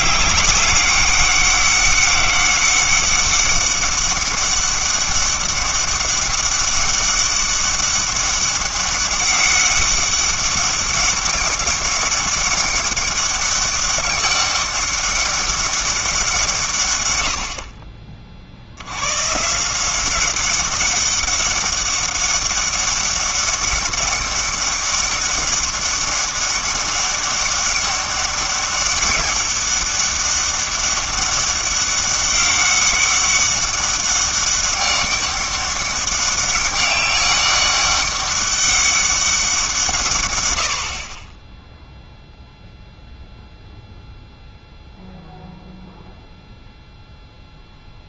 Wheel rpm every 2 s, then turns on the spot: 200, 200, 200, 200, 200, 190, 200, 200, 150, 70, 190, 200, 200, 200, 200, 200, 200, 190, 200, 200, 90, 0, 0, 0.
none